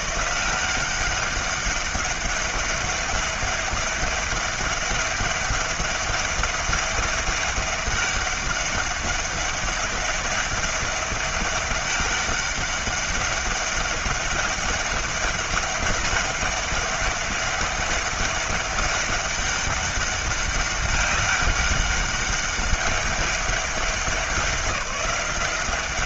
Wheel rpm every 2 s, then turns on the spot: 180, 200, 200, 190, 200, 200, 200, 200, 200, 200, 200, 200, 190.
none